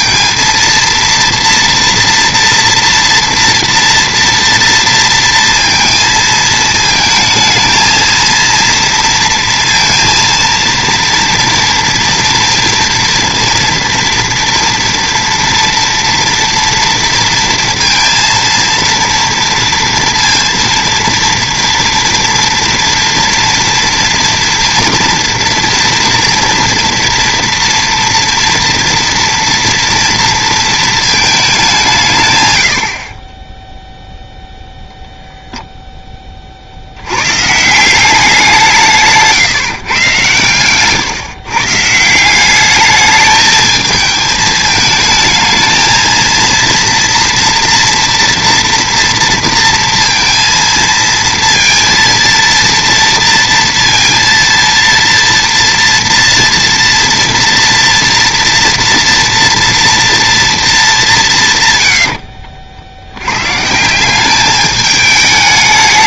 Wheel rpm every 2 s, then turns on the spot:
230, 230, 230, 220, 230, 230, 230, 230, 230, 230, 230, 230, 230, 230, 230, 230, 100, 0, 50, 180, 120, 200, 220, 230, 230, 230, 230, 230, 230, 230, 220, 70, 210.
none